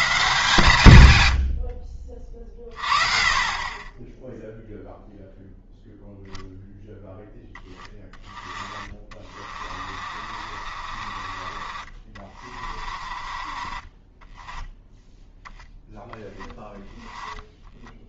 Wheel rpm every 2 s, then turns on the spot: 140, 40, 0, 10, 20, 40, 30, 10, 20.
2-4 8-18